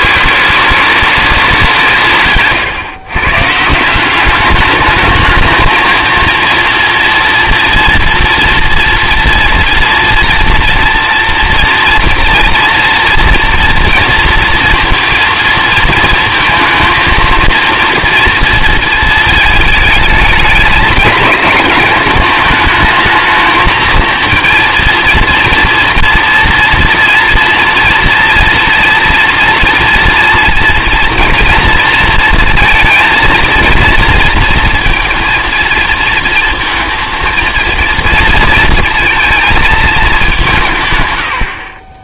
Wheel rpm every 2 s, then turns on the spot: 200, 140, 200, 240, 230, 230, 230, 230, 230, 230, 220, 210, 230, 230, 230, 230, 230, 230, 230, 230, 160.
none